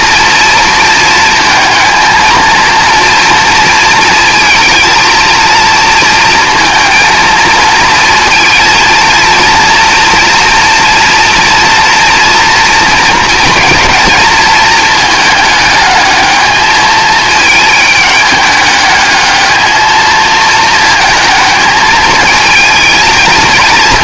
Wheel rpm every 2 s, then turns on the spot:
230, 230, 230, 230, 230, 240, 230, 220, 220, 210, 220, 220.
none